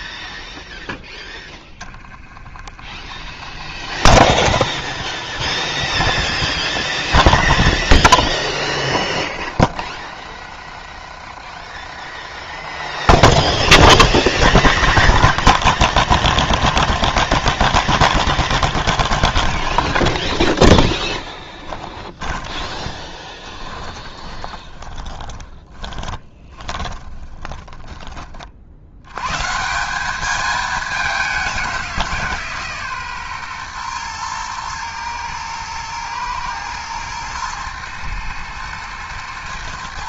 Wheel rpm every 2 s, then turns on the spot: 0, 20, 30, 40, 30, 30, 30, 50, 20, 30, 10, 20, 20, 20, 60, 210, 150, 120, 110, 110.
6-8 14-16 18-28